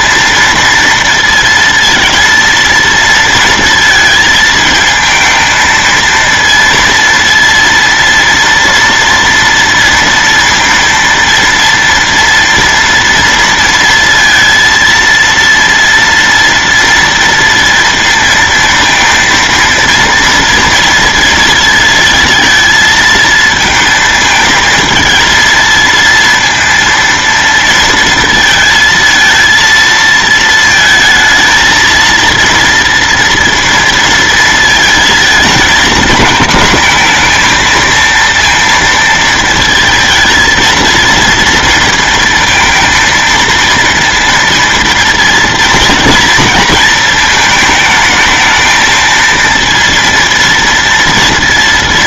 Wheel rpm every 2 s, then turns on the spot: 230, 230, 230, 230, 230, 230, 230, 230, 230, 230, 230, 220, 220, 230, 230, 220, 230, 230, 230, 230, 230, 230, 230, 220, 220, 230.
none